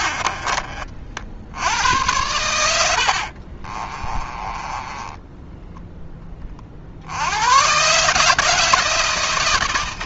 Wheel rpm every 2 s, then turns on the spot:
50, 80, 20, 70, 160.
4-6